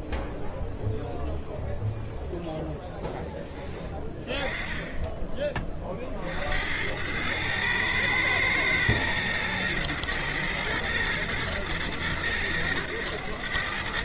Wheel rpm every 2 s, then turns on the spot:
0, 0, 20, 70, 110, 110, 110.
none